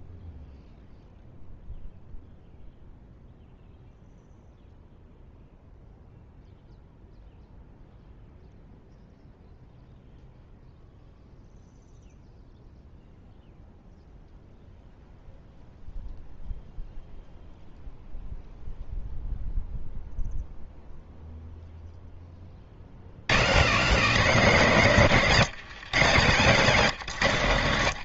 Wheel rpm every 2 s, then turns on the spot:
0, 0, 0, 0, 0, 0, 0, 0, 0, 0, 0, 30, 190, 150.
none